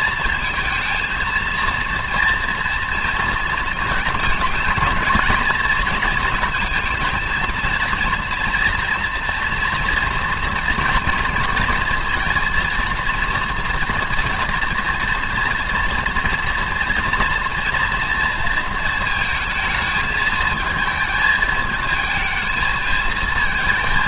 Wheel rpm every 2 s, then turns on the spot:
230, 230, 220, 220, 230, 240, 230, 230, 230, 230, 220, 220.
none